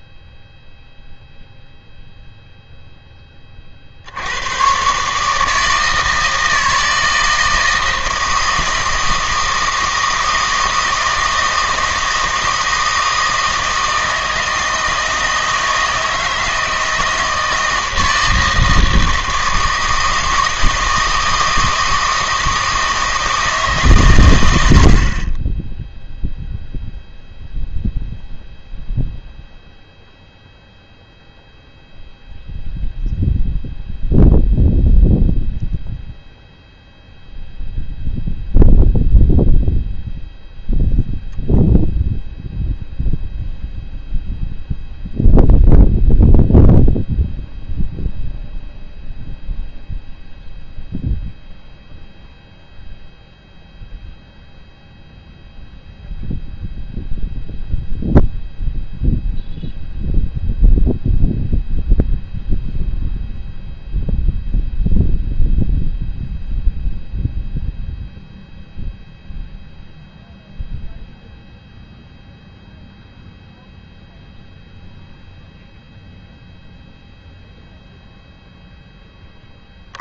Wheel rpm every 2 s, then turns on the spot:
0, 0, 120, 160, 160, 160, 160, 160, 160, 160, 160, 160, 80, 0, 0, 0, 0, 0, 0, 0, 0, 0, 0, 0, 0, 0, 0, 0, 0, 0, 0, 0, 0, 0, 0, 0, 0, 0, 0, 0.
none